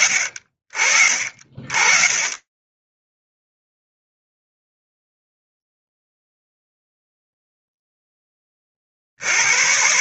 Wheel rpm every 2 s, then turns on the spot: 30, 10, 0, 0, 10.
none